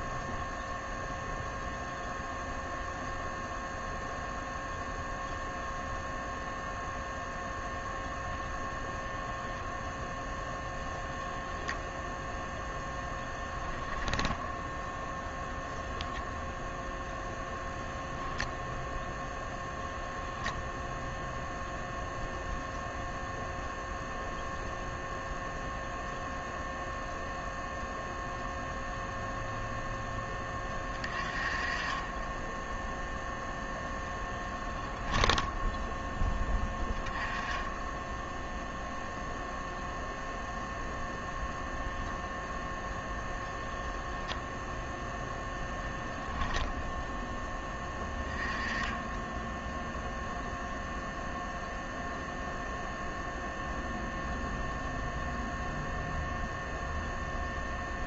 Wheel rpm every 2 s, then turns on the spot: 0, 0, 0, 0, 0, 10, 0, 0, 0, 0, 0, 0, 0, 0, 0, 20, 0, 10, 10, 0, 0, 0, 10, 0, 20, 0, 0, 0, 0.
34-36